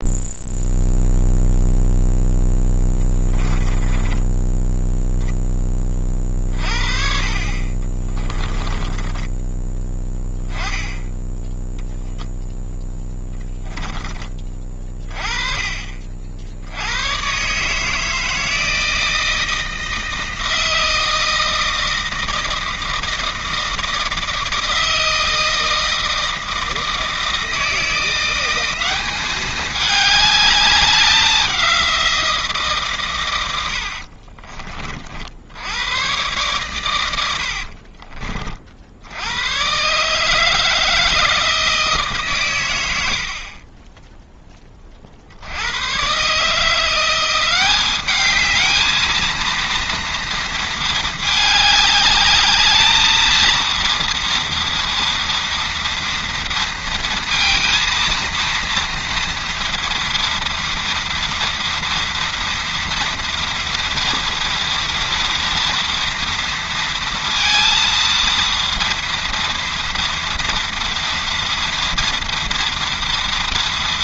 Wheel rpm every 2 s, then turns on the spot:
0, 10, 0, 50, 20, 10, 10, 40, 90, 160, 160, 160, 160, 160, 190, 200, 140, 40, 110, 60, 160, 90, 30, 170, 220, 220, 220, 240, 230, 230, 230, 230, 240, 230, 230, 240, 230.
8-10 12-14